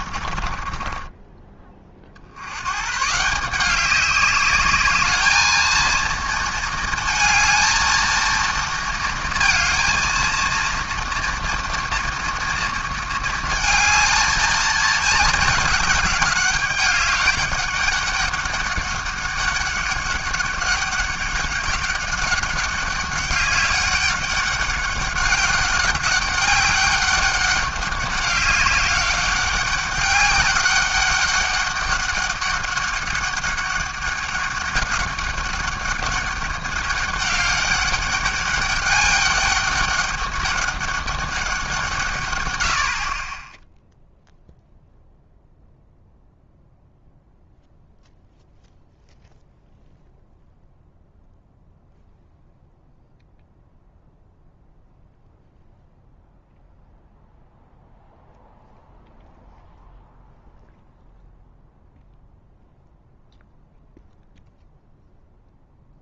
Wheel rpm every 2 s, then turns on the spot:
30, 100, 200, 220, 230, 230, 230, 220, 200, 200, 200, 200, 200, 200, 190, 200, 200, 200, 200, 200, 200, 110, 0, 0, 0, 0, 0, 0, 0, 0, 0, 0, 0.
0-2